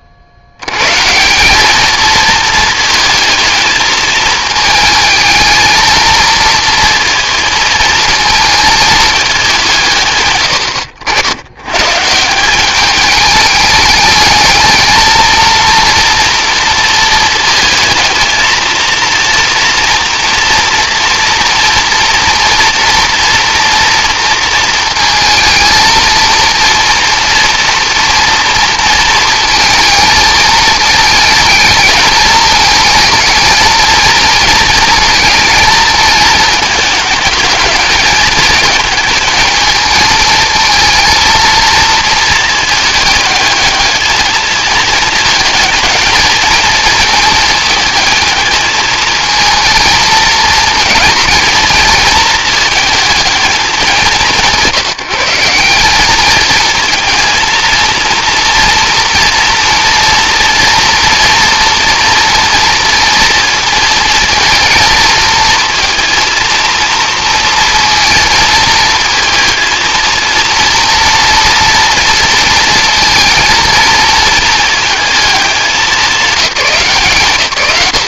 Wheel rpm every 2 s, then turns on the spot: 60, 220, 220, 230, 220, 100, 180, 220, 230, 230, 230, 240, 230, 230, 230, 220, 220, 230, 220, 220, 220, 220, 220, 220, 220, 230, 230, 160, 220, 230, 230, 230, 230, 230, 230, 230, 230, 220, 220.
none